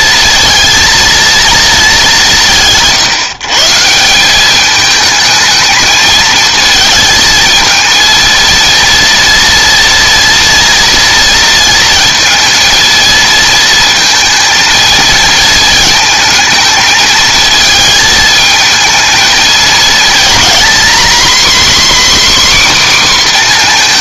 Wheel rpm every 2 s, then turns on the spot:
230, 170, 200, 220, 230, 230, 230, 220, 220, 220, 240, 270.
none